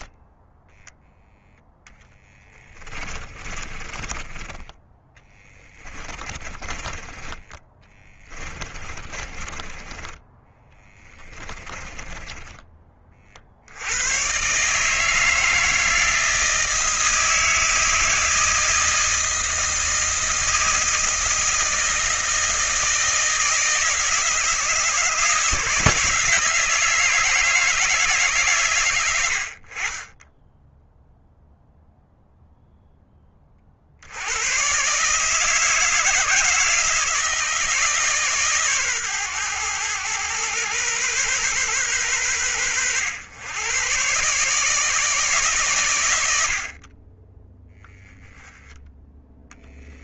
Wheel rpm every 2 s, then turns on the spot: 10, 20, 20, 20, 20, 20, 30, 150, 160, 160, 160, 160, 160, 160, 110, 0, 0, 140, 160, 130, 120, 100, 150, 30, 10.
2-12